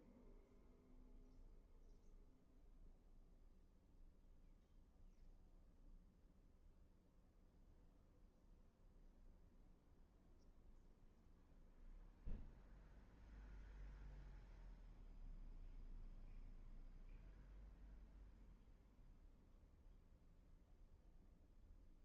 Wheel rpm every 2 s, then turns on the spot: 0, 0, 0, 0, 0, 0, 0, 0, 0, 0, 0.
none